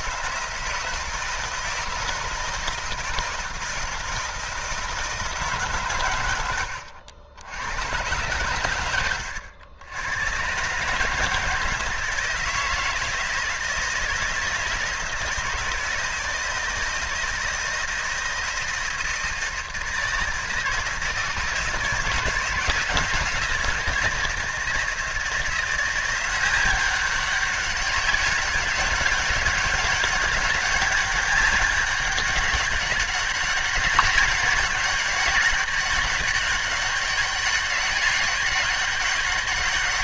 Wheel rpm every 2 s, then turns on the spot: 160, 160, 160, 80, 100, 140, 160, 160, 160, 160, 160, 170, 160, 190, 200, 200, 200, 190, 200, 200.
6-8